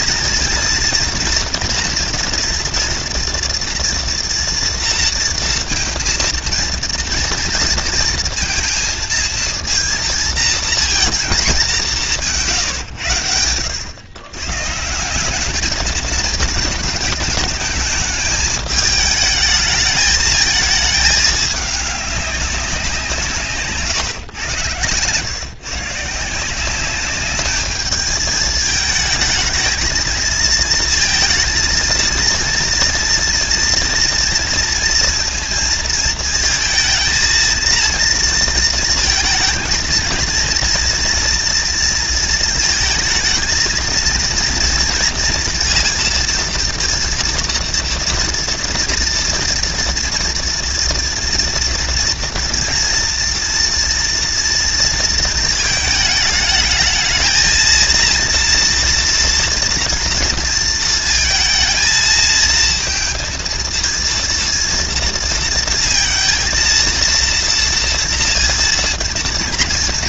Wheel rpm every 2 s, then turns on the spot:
230, 230, 230, 230, 230, 230, 140, 140, 220, 210, 220, 190, 120, 180, 220, 220, 230, 230, 230, 230, 230, 230, 230, 230, 230, 230, 230, 230, 220, 230, 220, 220, 230, 230, 230.
none